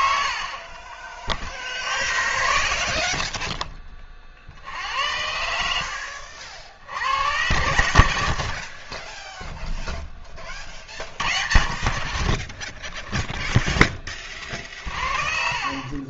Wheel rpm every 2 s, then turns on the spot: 50, 40, 60, 60, 50, 30, 10, 40.
8-10